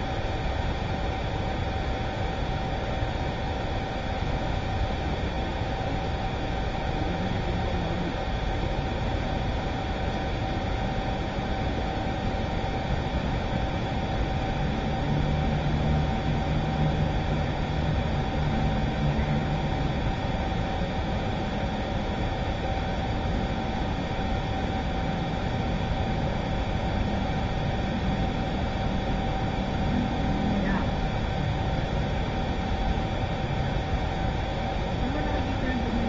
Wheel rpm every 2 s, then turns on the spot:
0, 0, 0, 0, 0, 0, 0, 0, 0, 0, 0, 0, 0, 0, 0, 0, 0, 0.
none